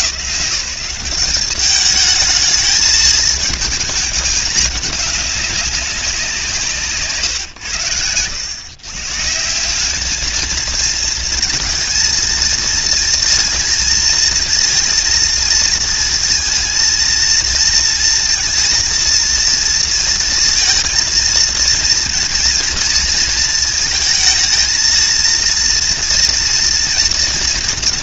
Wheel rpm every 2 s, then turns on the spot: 200, 220, 210, 150, 130, 220, 230, 230, 230, 230, 230, 230, 230, 240.
none